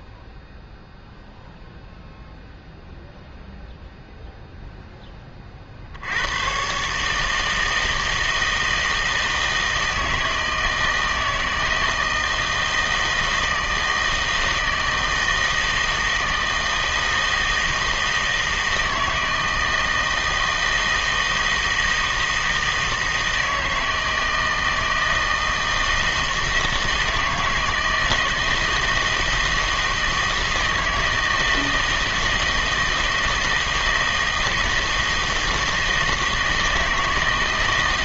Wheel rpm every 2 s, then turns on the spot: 0, 0, 0, 120, 160, 160, 160, 160, 160, 160, 160, 160, 160, 160, 160, 160, 160, 160, 160.
none